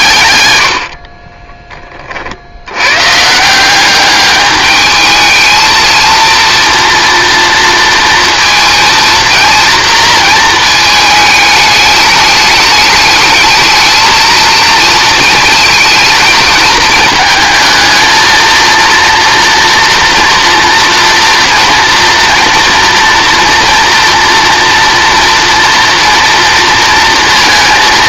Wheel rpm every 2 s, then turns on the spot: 90, 80, 210, 230, 230, 220, 210, 230, 220, 230, 230, 230, 230, 230.
none